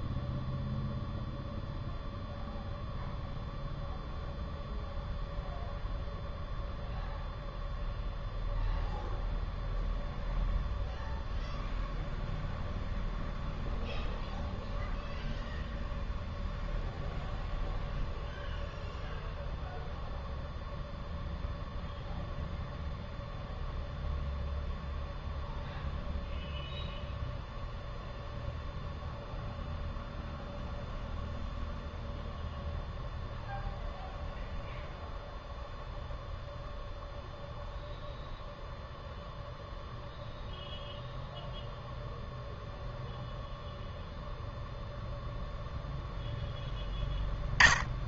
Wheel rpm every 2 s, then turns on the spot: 0, 0, 0, 0, 0, 0, 0, 0, 0, 0, 0, 0, 0, 0, 0, 0, 0, 0, 0, 0, 0, 0, 0, 0.
none